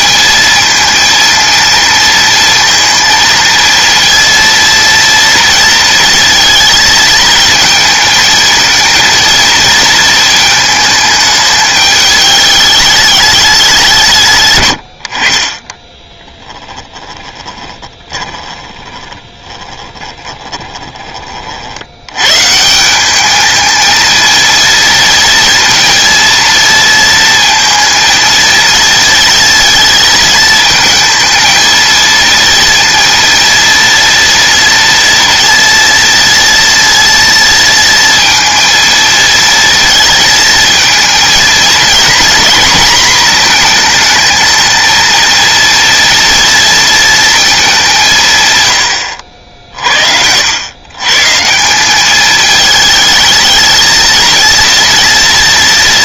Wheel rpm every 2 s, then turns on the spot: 230, 230, 230, 230, 230, 220, 210, 90, 10, 20, 20, 160, 230, 230, 220, 230, 230, 240, 230, 230, 220, 230, 220, 230, 100, 110, 220, 230.
14-22